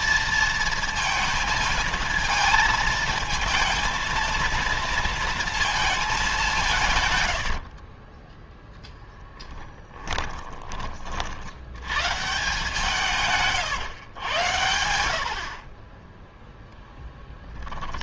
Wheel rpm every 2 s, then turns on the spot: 230, 220, 230, 140, 10, 30, 150, 70, 10.
6-8